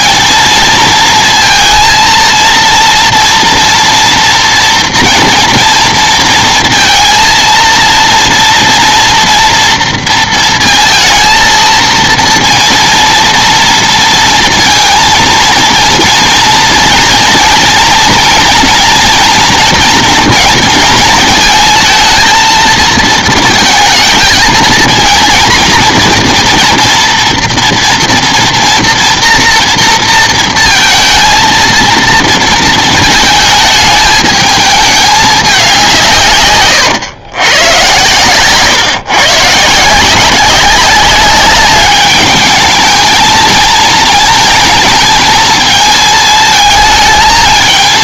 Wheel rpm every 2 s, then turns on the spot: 230, 230, 230, 230, 230, 230, 230, 230, 230, 230, 230, 230, 230, 240, 230, 230, 220, 210, 130, 130, 190, 210, 220, 220.
none